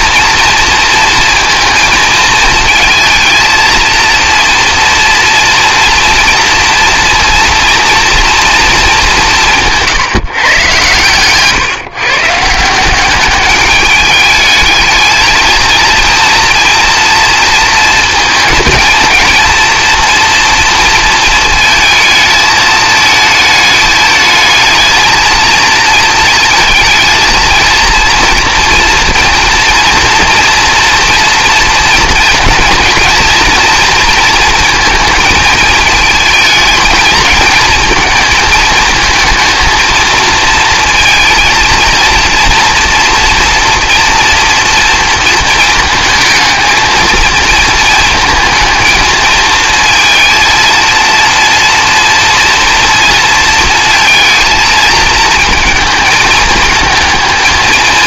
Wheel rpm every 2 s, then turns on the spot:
230, 220, 230, 230, 210, 120, 180, 220, 230, 220, 230, 220, 220, 230, 230, 240, 230, 230, 220, 220, 230, 240, 230, 220, 220, 230, 230, 220, 220.
none